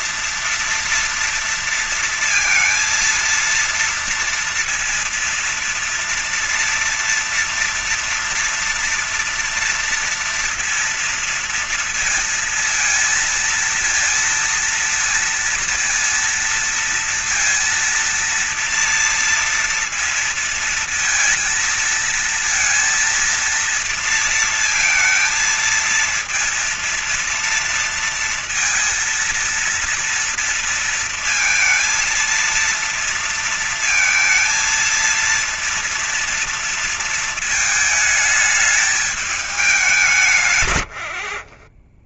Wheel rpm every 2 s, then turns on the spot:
240, 230, 230, 230, 230, 230, 220, 230, 230, 230, 230, 230, 230, 230, 230, 230, 230, 230, 230, 210, 90.
none